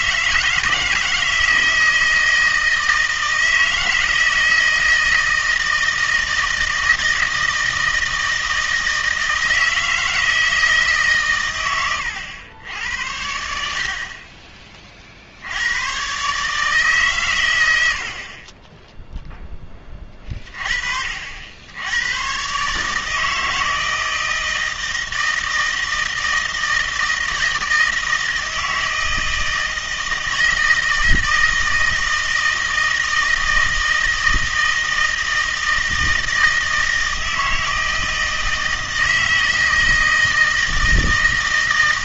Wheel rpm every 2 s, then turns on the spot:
160, 160, 160, 160, 160, 150, 80, 40, 150, 20, 40, 150, 160, 160, 160, 160, 160, 160, 160, 160, 160.
none